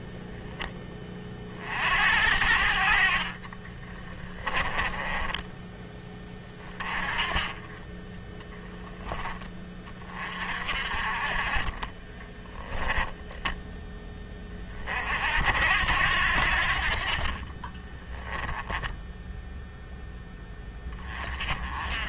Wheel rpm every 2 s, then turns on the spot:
20, 60, 20, 20, 10, 50, 10, 40, 50, 10, 20.
4-6 12-14